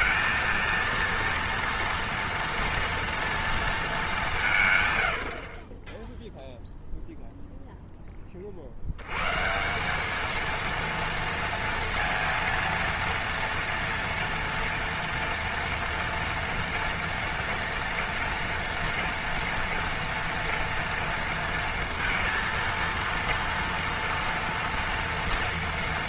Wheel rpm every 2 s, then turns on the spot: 230, 230, 160, 0, 70, 230, 230, 230, 230, 230, 240, 230, 240.
none